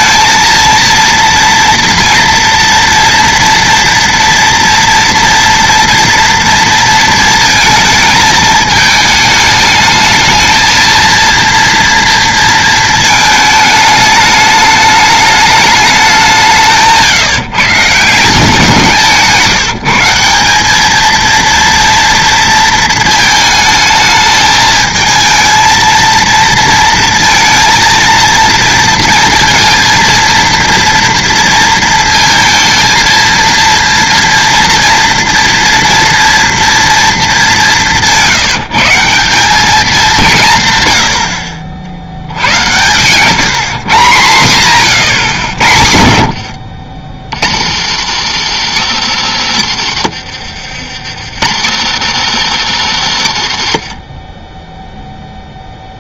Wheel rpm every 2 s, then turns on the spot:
230, 240, 230, 230, 210, 220, 230, 210, 170, 180, 200, 230, 220, 230, 230, 230, 230, 230, 230, 170, 150, 90, 140, 80, 150, 80, 170, 20.
46-48